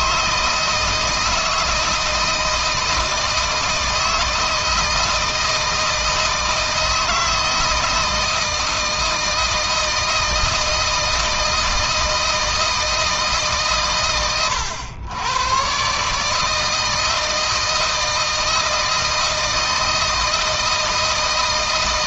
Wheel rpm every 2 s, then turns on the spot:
160, 160, 160, 160, 160, 160, 160, 100, 160, 160, 160.
none